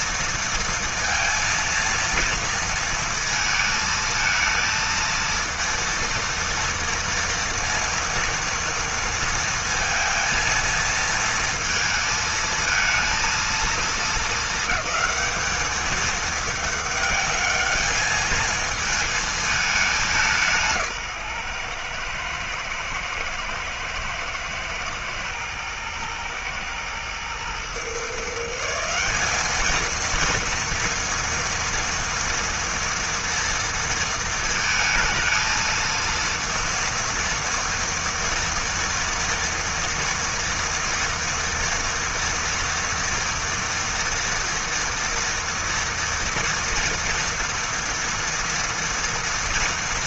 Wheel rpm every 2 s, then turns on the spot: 230, 220, 230, 230, 230, 230, 230, 210, 210, 220, 140, 110, 110, 110, 190, 230, 230, 220, 230, 230, 230, 230, 230, 230, 230.
none